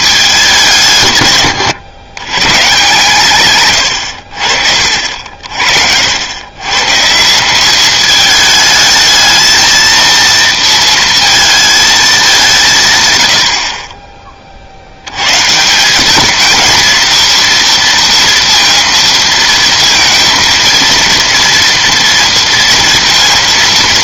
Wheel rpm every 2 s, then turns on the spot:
190, 130, 60, 130, 210, 230, 150, 60, 220, 230, 230, 230.
none